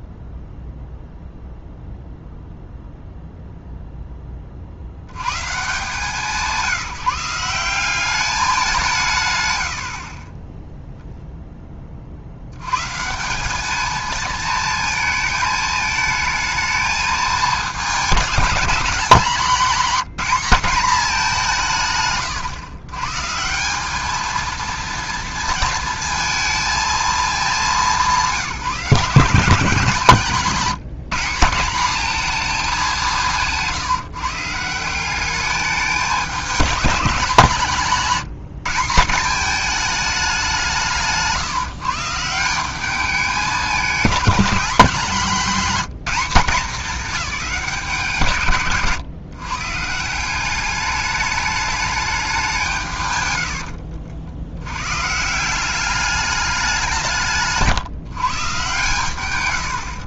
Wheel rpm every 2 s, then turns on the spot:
0, 0, 60, 180, 190, 0, 130, 220, 220, 200, 210, 140, 230, 220, 170, 180, 200, 170, 210, 180, 160, 190, 200, 220, 130, 200, 150, 120, 180, 100.
none